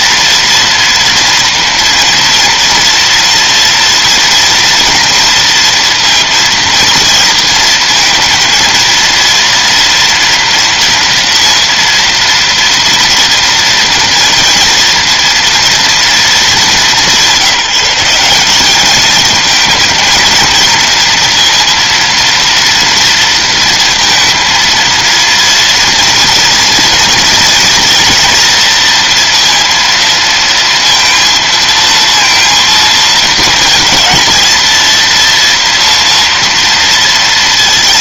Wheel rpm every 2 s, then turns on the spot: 230, 230, 230, 230, 230, 230, 230, 230, 200, 210, 230, 230, 230, 230, 240, 230, 230, 220, 230.
none